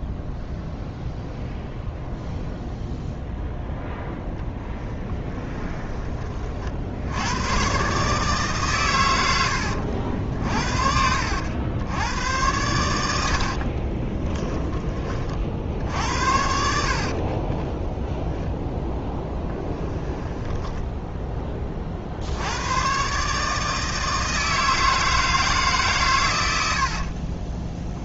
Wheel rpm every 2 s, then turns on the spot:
0, 0, 10, 60, 120, 60, 90, 20, 60, 10, 10, 110, 160, 60.
4-6 16-22